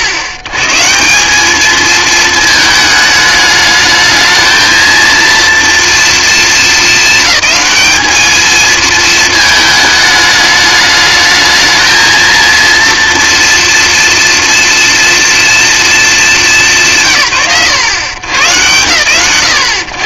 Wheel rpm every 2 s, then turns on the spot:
120, 220, 220, 220, 220, 210, 230, 230, 170, 90.
none